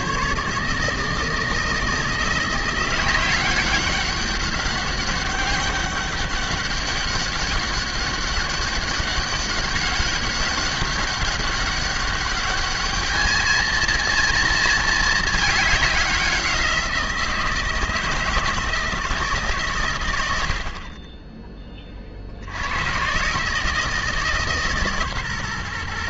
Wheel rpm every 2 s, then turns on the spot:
150, 180, 200, 200, 200, 190, 210, 230, 170, 160, 40, 90, 150.
none